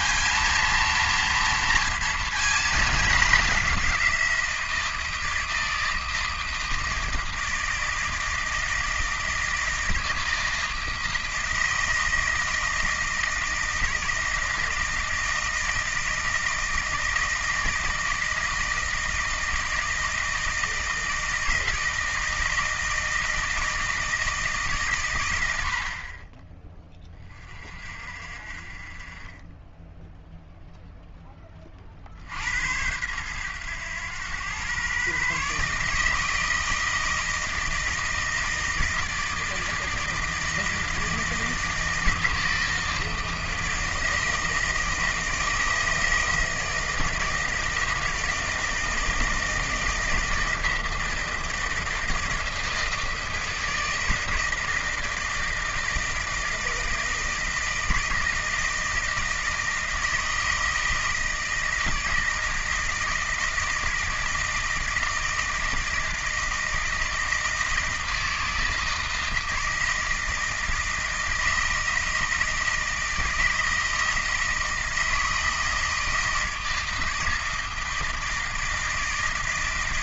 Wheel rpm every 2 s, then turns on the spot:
230, 220, 170, 160, 160, 160, 160, 160, 160, 160, 160, 160, 150, 20, 40, 0, 90, 120, 160, 160, 160, 160, 160, 160, 160, 160, 160, 160, 160, 160, 160, 160, 160, 160, 160, 160, 160, 160, 160, 170.
none